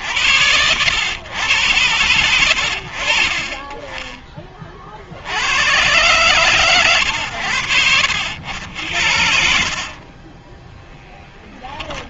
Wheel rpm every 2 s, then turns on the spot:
80, 50, 20, 130, 80, 20.
10-12